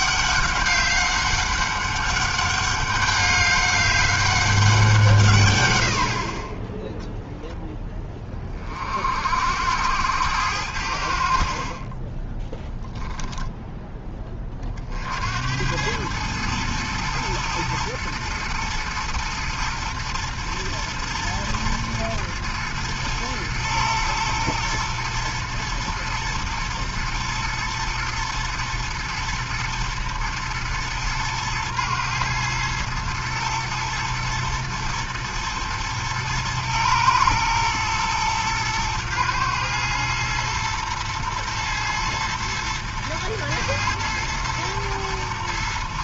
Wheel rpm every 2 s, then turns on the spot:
200, 200, 180, 10, 30, 80, 0, 30, 110, 110, 120, 110, 110, 110, 110, 110, 110, 110, 110, 110, 110, 110, 120.
none